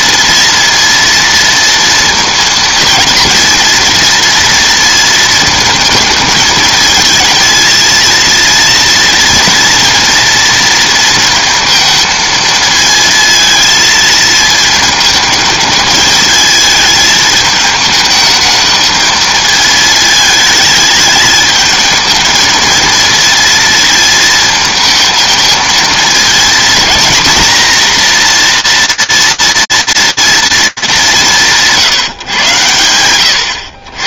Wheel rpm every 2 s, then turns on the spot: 230, 220, 230, 220, 230, 230, 220, 220, 220, 220, 220, 230, 220, 220, 230, 190, 100.
none